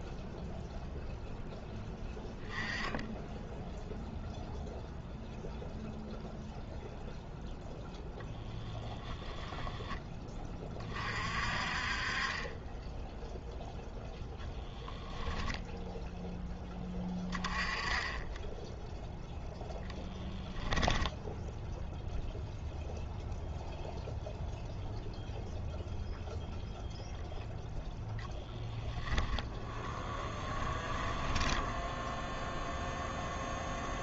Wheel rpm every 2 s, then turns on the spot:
0, 10, 0, 0, 20, 30, 20, 0, 20, 10, 0, 0, 0, 0, 10, 10, 0.
8-10 30-32